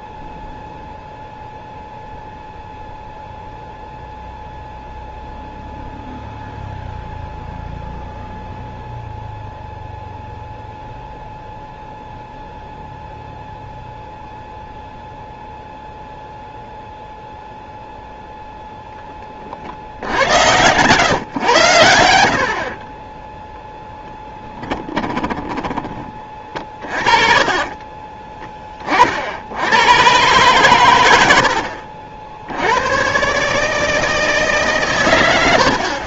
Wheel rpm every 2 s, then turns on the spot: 0, 0, 0, 0, 0, 0, 0, 0, 0, 0, 120, 60, 10, 30, 30, 120, 90, 140.
20-22 24-28